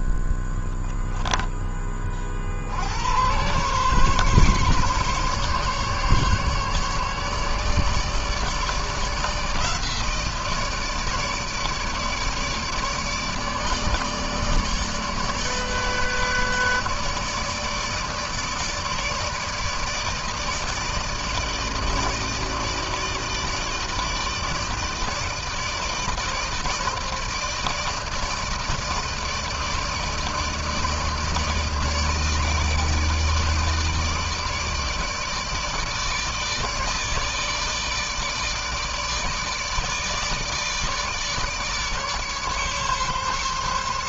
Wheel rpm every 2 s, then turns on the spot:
0, 50, 140, 140, 150, 160, 150, 150, 150, 160, 160, 160, 160, 160, 160, 150, 160, 160, 160, 160, 150, 140.
none